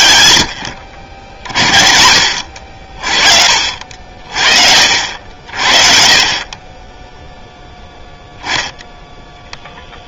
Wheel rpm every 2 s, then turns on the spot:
90, 50, 70, 10, 0.
none